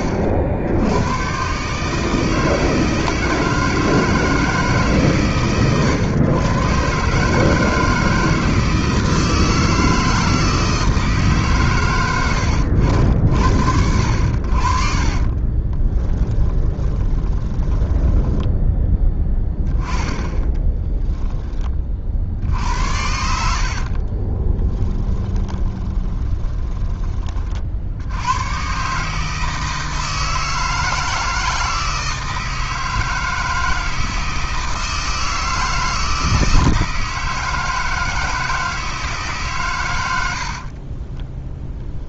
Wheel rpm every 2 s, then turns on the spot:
80, 160, 150, 130, 160, 160, 70, 50, 30, 10, 10, 70, 20, 20, 130, 160, 160, 160, 160, 160, 40.
14-18 20-26 40-42